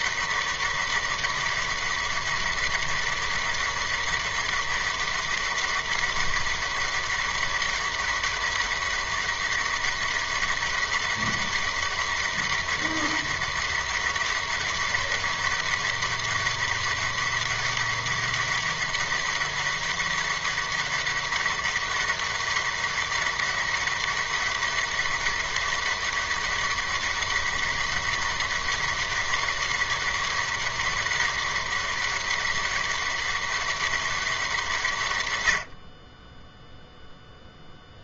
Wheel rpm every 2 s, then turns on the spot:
200, 200, 200, 200, 200, 200, 200, 200, 200, 200, 200, 200, 200, 200, 200, 200, 200, 130, 0.
none